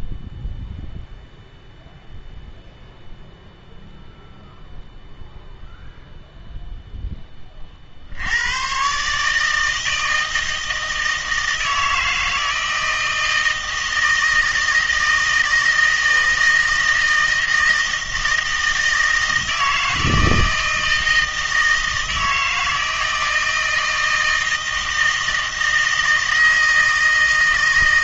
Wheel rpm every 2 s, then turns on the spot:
0, 0, 0, 0, 120, 160, 160, 160, 160, 160, 160, 160, 160, 160.
none